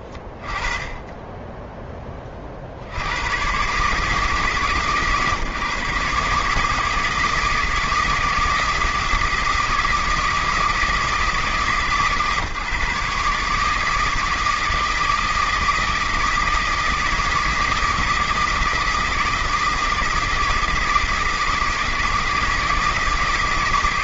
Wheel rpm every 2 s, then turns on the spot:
80, 140, 160, 160, 160, 150, 160, 160, 160, 160, 160, 160.
none